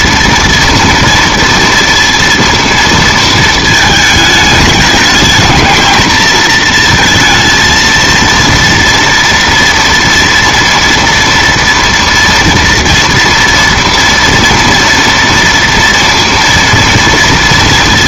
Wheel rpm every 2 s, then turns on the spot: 230, 230, 210, 230, 230, 230, 240, 230, 230.
none